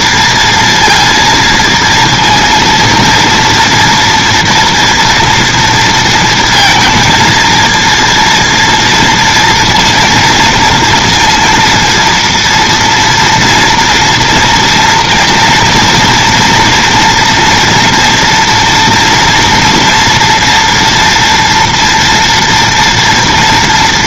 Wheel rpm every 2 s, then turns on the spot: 230, 230, 230, 230, 230, 230, 230, 230, 240, 230, 230, 240.
none